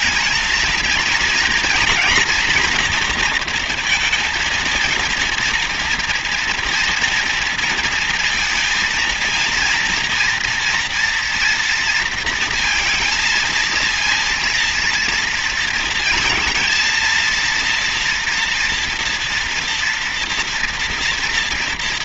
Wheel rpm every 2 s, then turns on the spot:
220, 230, 230, 240, 230, 230, 230, 230, 230, 230, 240.
none